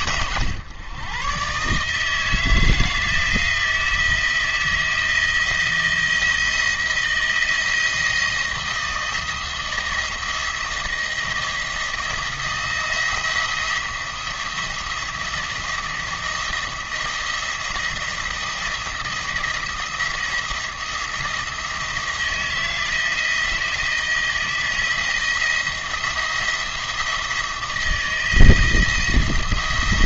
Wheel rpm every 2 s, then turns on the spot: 120, 160, 170, 170, 160, 160, 170, 170, 170, 170, 170, 170, 160, 170, 160.
none